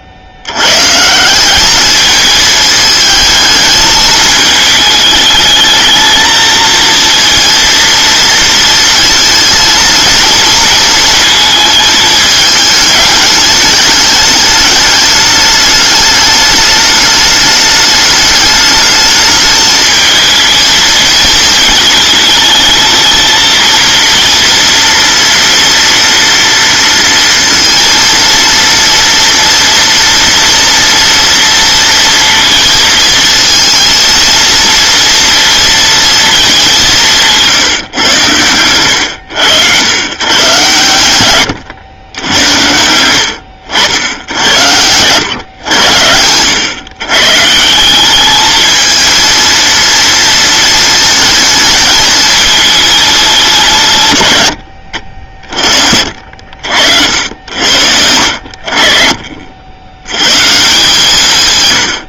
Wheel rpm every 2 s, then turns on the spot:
120, 220, 210, 230, 230, 230, 210, 210, 210, 210, 220, 220, 230, 230, 230, 230, 230, 230, 200, 110, 120, 90, 90, 110, 220, 230, 220, 70, 70, 60, 150.
none